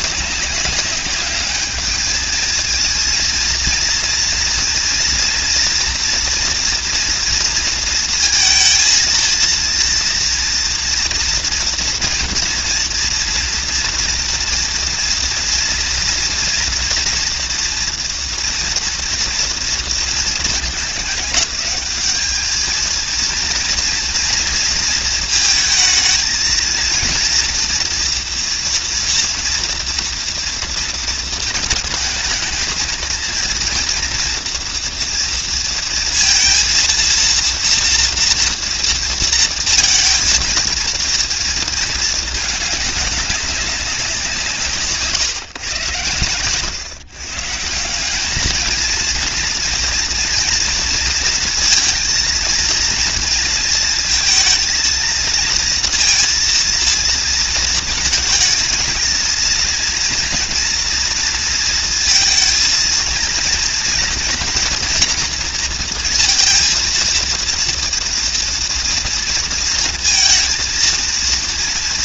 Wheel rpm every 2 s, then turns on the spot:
200, 230, 230, 230, 230, 230, 230, 240, 230, 240, 210, 220, 230, 230, 230, 230, 220, 230, 230, 230, 230, 210, 140, 130, 230, 230, 230, 230, 230, 230, 230, 230, 230, 230, 230, 230.
none